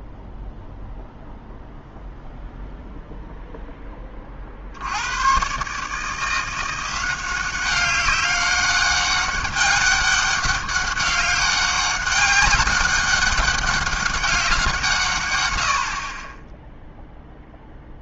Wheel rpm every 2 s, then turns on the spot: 0, 0, 70, 180, 200, 200, 200, 170, 10.
none